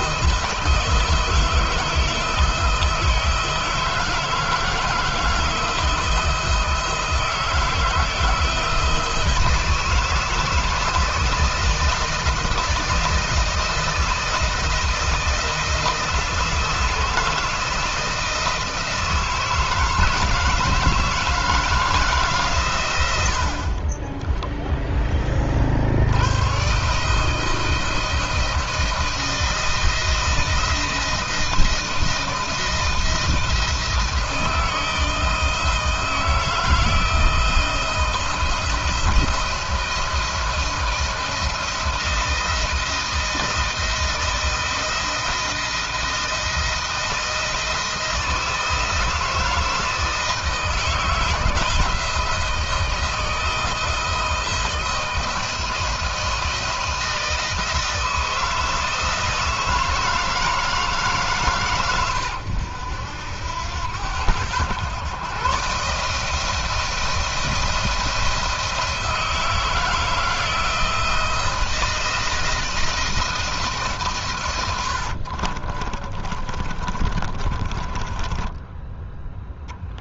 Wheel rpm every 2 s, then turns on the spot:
160, 160, 160, 160, 160, 160, 160, 160, 160, 160, 160, 120, 20, 140, 160, 170, 170, 160, 160, 170, 170, 170, 170, 170, 170, 160, 160, 160, 170, 160, 150, 90, 120, 170, 160, 160, 160, 80, 30, 10.
24-26 74-80